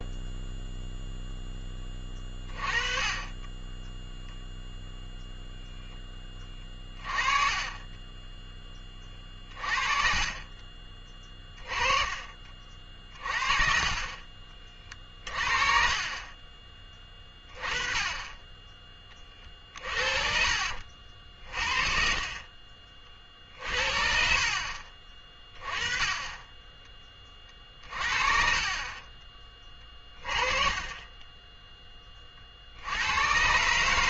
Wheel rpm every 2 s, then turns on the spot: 0, 20, 0, 20, 20, 30, 40, 40, 20, 20, 50, 40, 40, 20, 30, 20, 70.
6-8 10-12 14-16